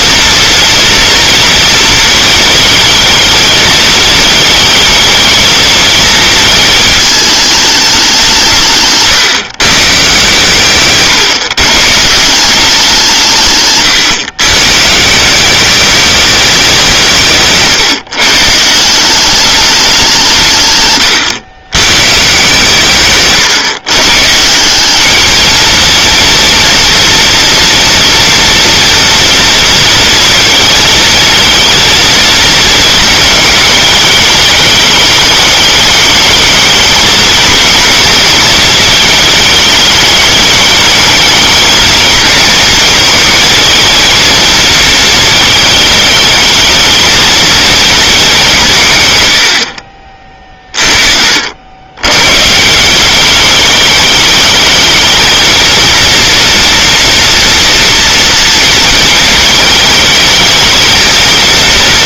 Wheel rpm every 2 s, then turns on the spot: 230, 220, 220, 220, 140, 140, 180, 150, 180, 170, 120, 140, 200, 230, 230, 220, 220, 210, 220, 220, 210, 230, 230, 230, 150, 40, 180, 220, 230, 220, 230.
8-12